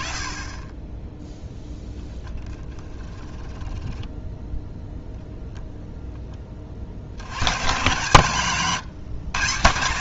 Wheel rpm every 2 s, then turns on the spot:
10, 10, 0, 50, 160.
2-4